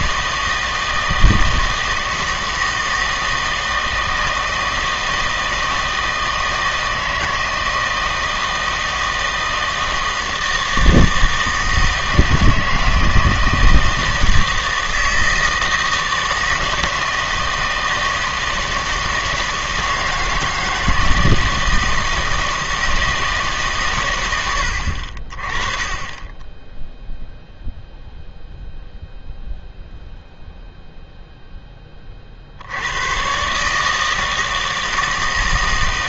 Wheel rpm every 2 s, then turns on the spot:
160, 160, 160, 160, 160, 160, 160, 160, 160, 160, 160, 160, 80, 10, 0, 0, 80, 160.
none